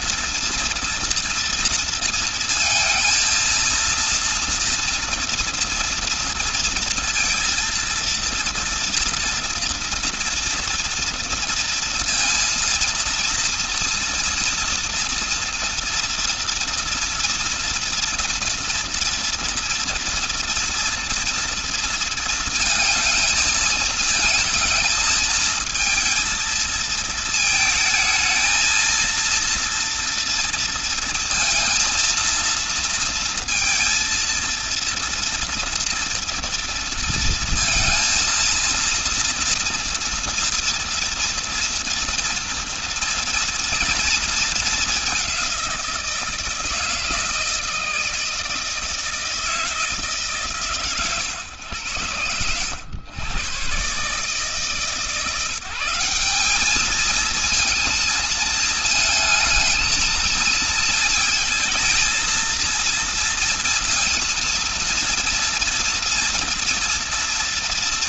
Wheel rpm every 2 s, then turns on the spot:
230, 230, 240, 230, 230, 230, 230, 230, 230, 230, 230, 220, 220, 220, 230, 230, 230, 230, 230, 230, 240, 230, 200, 160, 160, 120, 110, 160, 220, 230, 220, 230, 230, 230.
none